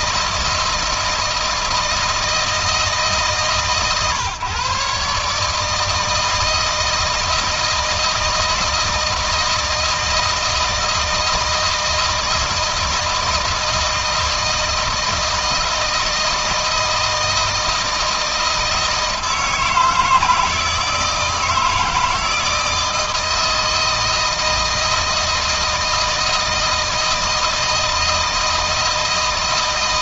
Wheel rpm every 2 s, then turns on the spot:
160, 150, 140, 160, 160, 160, 160, 160, 160, 160, 160, 160, 160, 160, 160.
none